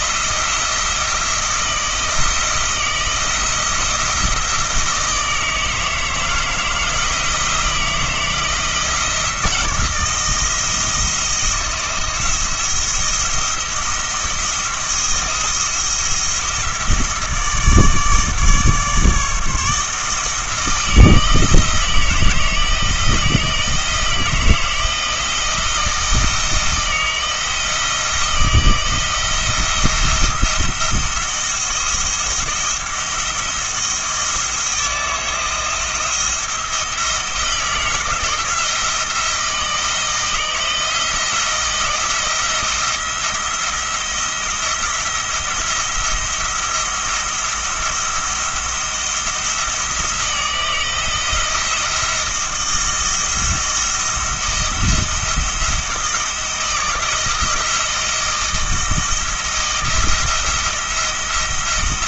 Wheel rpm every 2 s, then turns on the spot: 160, 160, 160, 160, 170, 170, 170, 170, 160, 150, 160, 160, 170, 160, 160, 170, 160, 160, 160, 160, 160, 170, 170, 170, 170, 170, 160, 170, 160, 160, 170.
none